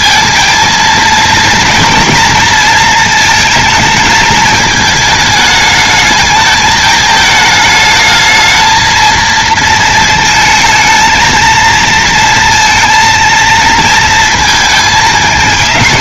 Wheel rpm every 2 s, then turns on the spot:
230, 220, 220, 220, 220, 220, 230, 220.
none